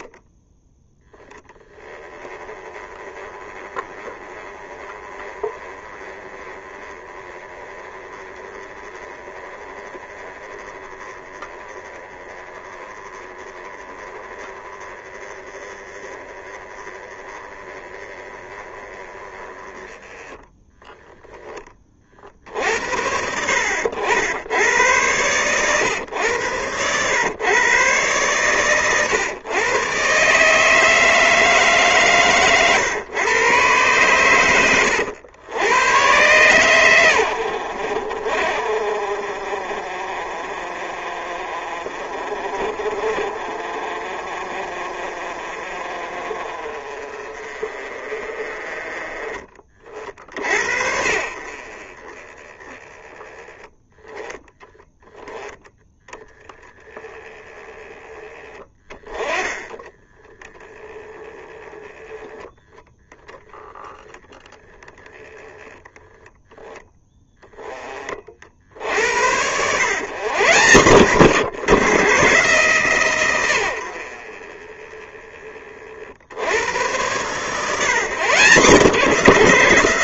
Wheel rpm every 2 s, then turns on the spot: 10, 20, 20, 20, 20, 20, 20, 20, 20, 20, 10, 70, 110, 120, 120, 160, 120, 80, 100, 50, 40, 40, 40, 40, 30, 70, 10, 10, 10, 20, 10, 0, 10, 10, 80, 130, 120, 20, 110, 160.
none